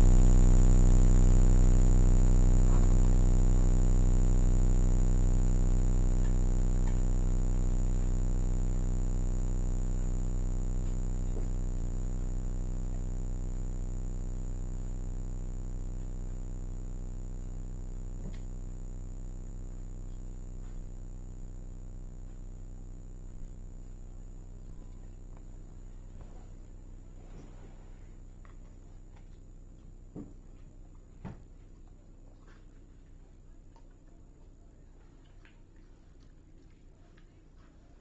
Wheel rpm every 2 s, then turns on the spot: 0, 0, 0, 0, 0, 0, 0, 0, 0, 0, 0, 0, 0, 0, 0, 0, 0, 0, 0.
none